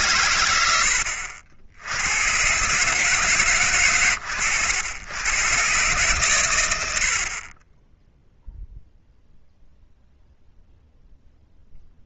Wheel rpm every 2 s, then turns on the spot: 70, 90, 70, 120, 0, 0.
none